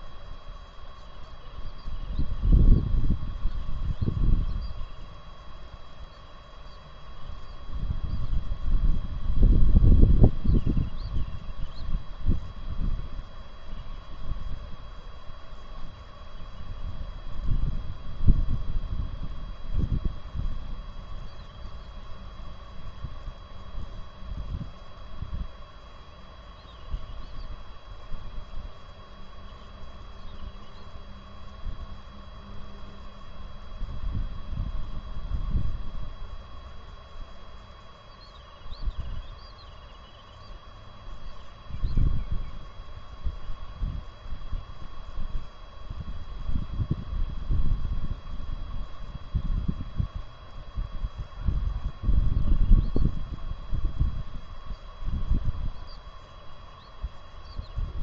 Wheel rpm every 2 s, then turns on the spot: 0, 0, 0, 0, 0, 0, 0, 0, 0, 0, 0, 0, 0, 0, 0, 0, 0, 0, 0, 0, 0, 0, 0, 0, 0, 0, 0, 0, 0.
none